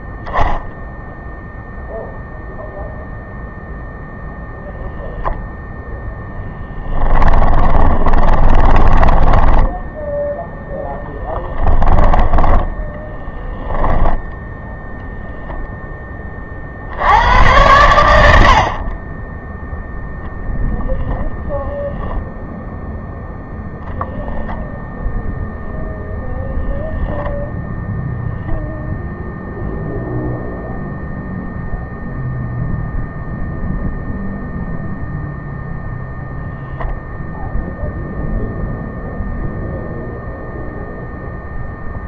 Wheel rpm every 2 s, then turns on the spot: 0, 0, 0, 10, 20, 10, 10, 0, 30, 50, 0, 0, 10, 0, 0, 0, 0, 0, 0, 0, 0.
6-10 12-14